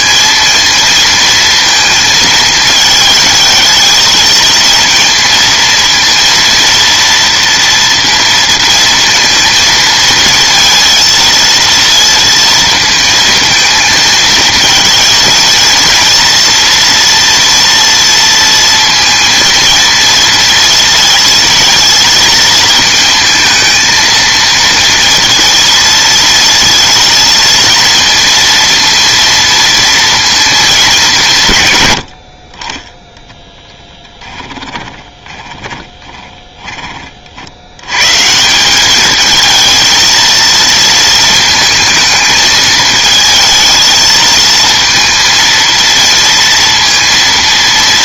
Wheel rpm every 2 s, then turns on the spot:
230, 220, 230, 230, 230, 230, 230, 230, 230, 230, 230, 220, 230, 230, 230, 210, 30, 10, 20, 200, 230, 220, 230, 230.
34-36